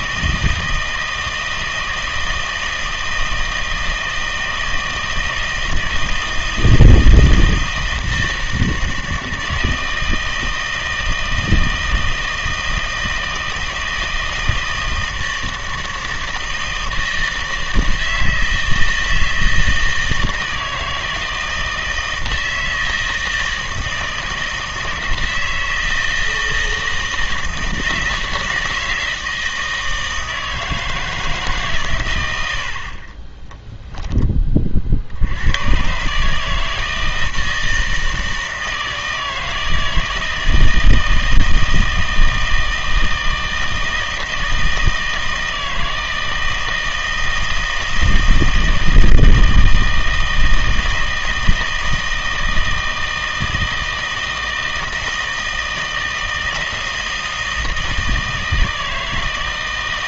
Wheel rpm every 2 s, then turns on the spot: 160, 160, 160, 160, 160, 160, 160, 160, 160, 160, 160, 160, 160, 160, 160, 160, 70, 40, 160, 160, 160, 160, 160, 160, 160, 160, 160, 160, 160, 160.
32-34